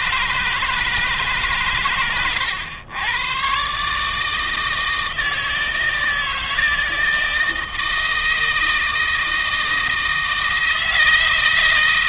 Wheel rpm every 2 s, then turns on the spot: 150, 110, 160, 160, 160, 160.
none